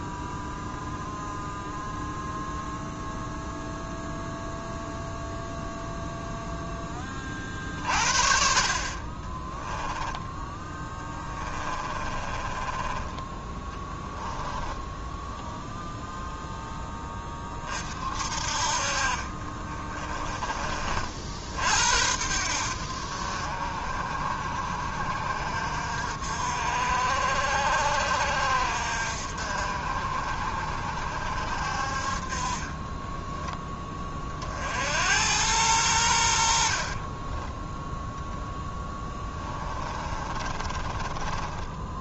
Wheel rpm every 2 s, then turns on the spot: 0, 0, 0, 20, 30, 10, 20, 10, 10, 50, 40, 70, 60, 60, 60, 60, 20, 80, 40, 10, 20.
10-16 32-34 36-42